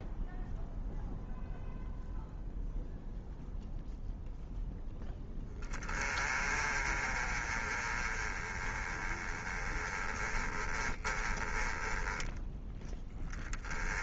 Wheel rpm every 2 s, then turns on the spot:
0, 0, 0, 30, 20, 30, 20.
none